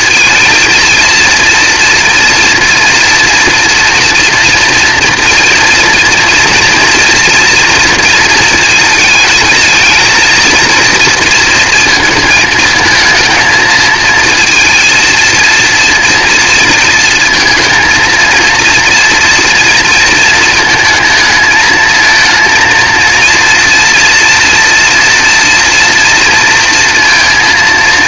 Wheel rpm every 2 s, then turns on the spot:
230, 240, 230, 230, 220, 230, 220, 220, 230, 230, 220, 230, 230, 230.
none